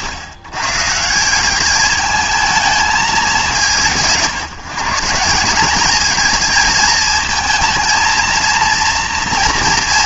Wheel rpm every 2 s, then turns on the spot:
130, 210, 170, 220, 230.
none